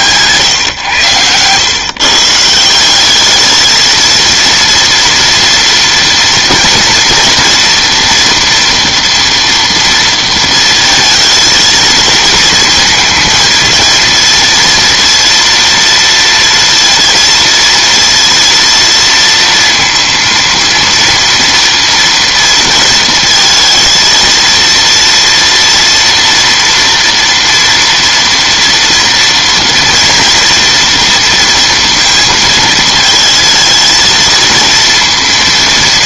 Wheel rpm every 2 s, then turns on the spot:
120, 180, 230, 230, 230, 230, 230, 230, 230, 230, 230, 230, 230, 230, 230, 230, 230, 230.
none